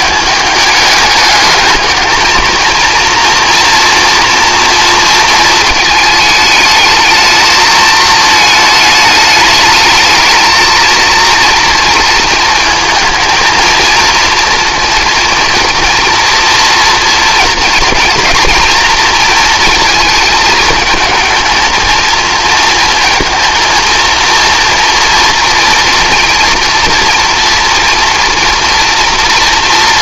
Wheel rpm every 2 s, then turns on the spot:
210, 230, 230, 220, 220, 220, 230, 230, 230, 230, 220, 230, 230, 230, 240.
none